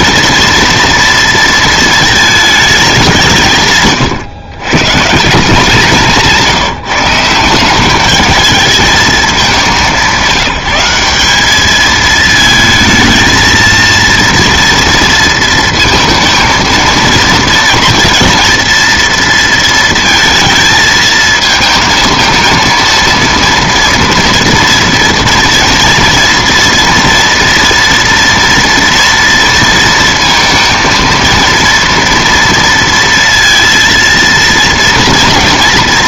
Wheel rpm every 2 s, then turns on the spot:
230, 220, 130, 170, 210, 180, 220, 230, 230, 230, 230, 230, 230, 230, 240, 230, 230, 230.
none